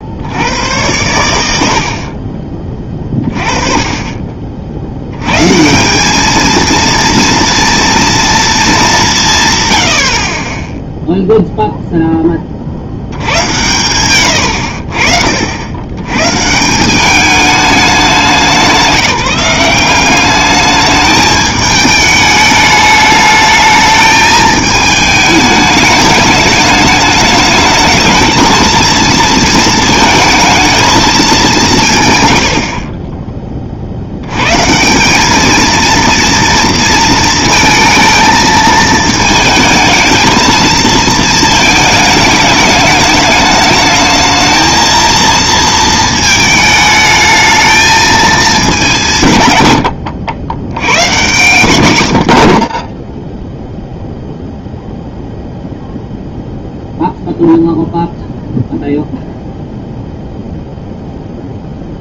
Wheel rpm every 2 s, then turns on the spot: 100, 20, 60, 230, 210, 10, 50, 80, 160, 180, 210, 210, 220, 210, 220, 220, 70, 140, 230, 220, 230, 210, 220, 220, 210, 100, 40, 0, 0, 0, 0.
none